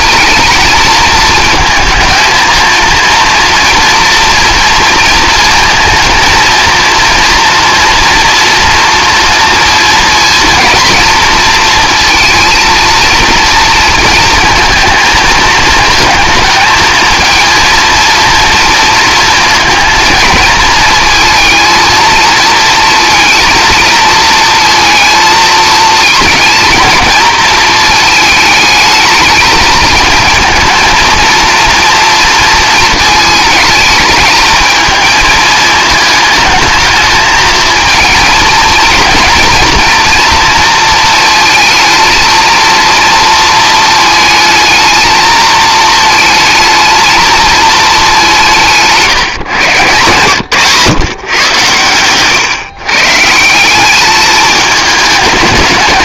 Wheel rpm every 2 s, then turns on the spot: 220, 230, 230, 230, 230, 230, 230, 230, 220, 230, 220, 230, 230, 230, 220, 230, 230, 220, 220, 220, 230, 230, 220, 220, 160, 130, 130, 220.
none